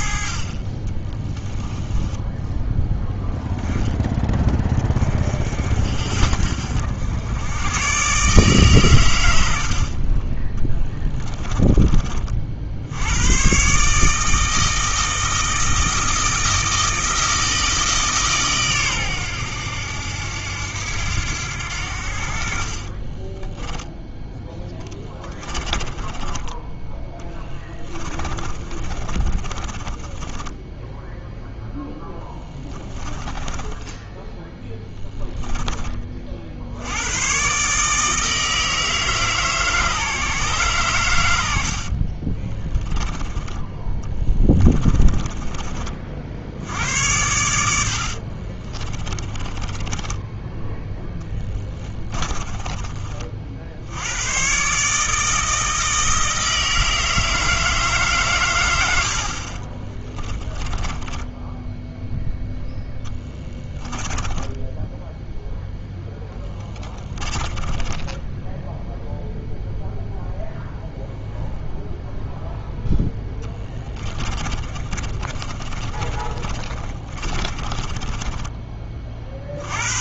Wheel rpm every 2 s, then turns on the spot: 30, 10, 20, 70, 130, 10, 70, 160, 160, 130, 80, 40, 10, 20, 30, 10, 20, 10, 70, 160, 130, 20, 20, 70, 30, 10, 20, 140, 160, 90, 20, 0, 10, 10, 0, 0, 0, 30, 30, 20.
10-12 24-26 28-36 42-46 48-50 60-62 64-68 74-78